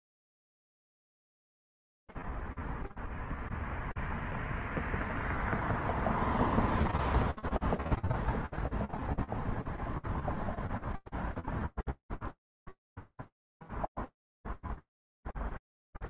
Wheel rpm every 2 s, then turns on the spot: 0, 0, 0, 0, 0, 0, 0, 0.
none